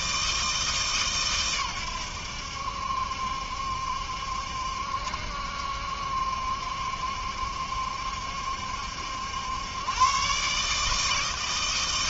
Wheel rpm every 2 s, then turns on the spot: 160, 80, 70, 70, 70, 140.
none